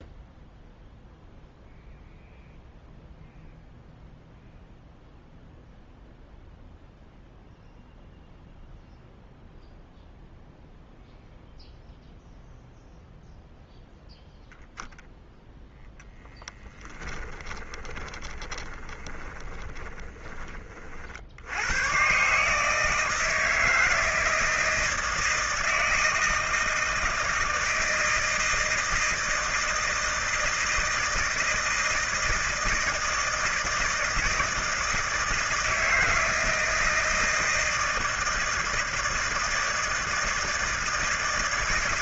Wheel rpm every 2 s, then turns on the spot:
0, 0, 0, 0, 0, 0, 0, 0, 20, 20, 50, 150, 160, 160, 160, 160, 160, 160, 160, 160, 160.
16-20